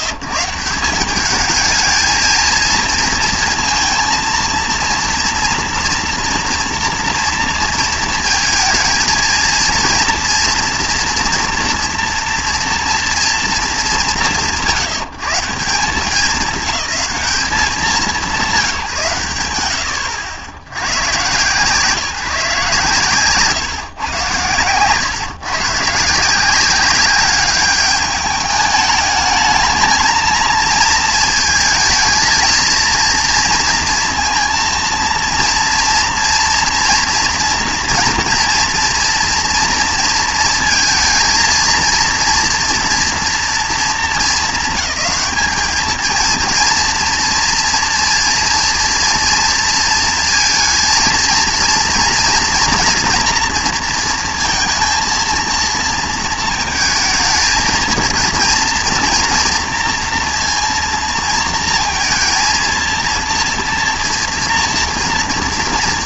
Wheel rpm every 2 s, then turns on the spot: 150, 230, 230, 230, 230, 230, 240, 140, 200, 160, 90, 140, 120, 200, 210, 220, 230, 230, 230, 230, 230, 230, 210, 230, 230, 230, 240, 230, 220, 230, 230, 230, 230.
none